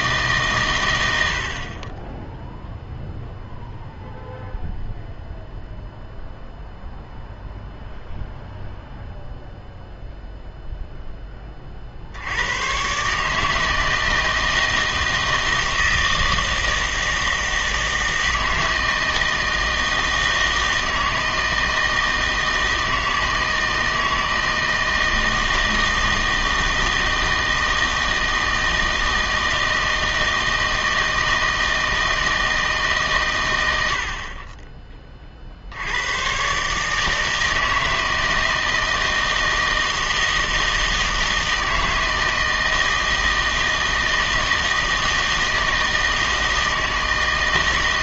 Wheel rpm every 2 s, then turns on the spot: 110, 0, 0, 0, 0, 0, 120, 160, 160, 160, 160, 160, 160, 160, 160, 160, 150, 20, 140, 160, 160, 160, 160, 160.
none